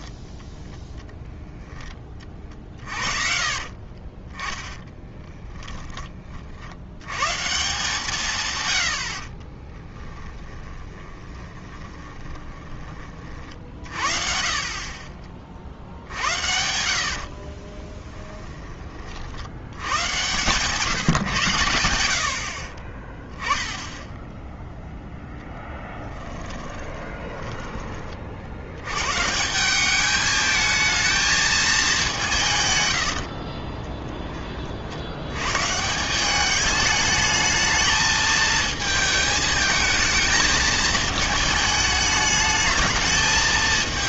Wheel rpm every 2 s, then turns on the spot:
10, 40, 20, 80, 110, 20, 20, 40, 70, 20, 140, 30, 0, 20, 90, 220, 120, 40, 210, 220, 220, 220.
4-6 10-12 16-18 26-28